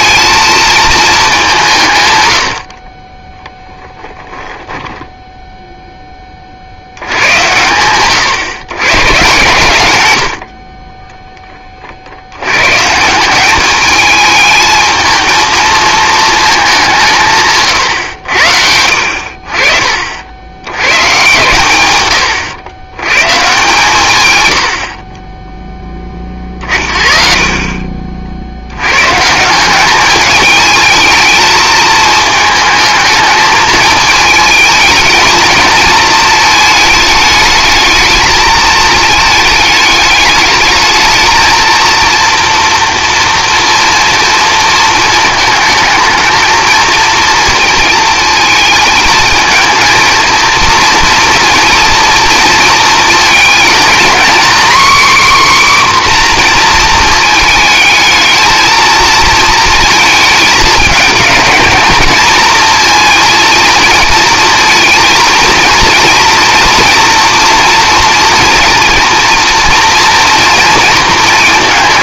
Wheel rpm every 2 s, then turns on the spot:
220, 40, 10, 80, 140, 30, 150, 220, 180, 70, 120, 120, 60, 40, 120, 210, 220, 220, 220, 220, 220, 240, 230, 230, 220, 230, 230, 270, 230, 230, 220, 230, 230, 230, 230, 230.
none